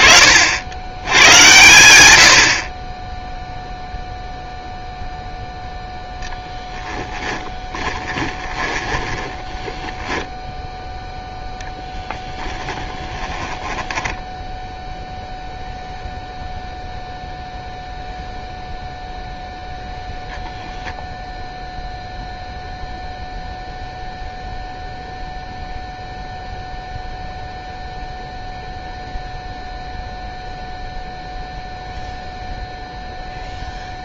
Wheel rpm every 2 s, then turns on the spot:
80, 10, 0, 10, 20, 0, 10, 0, 0, 0, 0, 0, 0, 0, 0, 0, 0.
8-10 12-14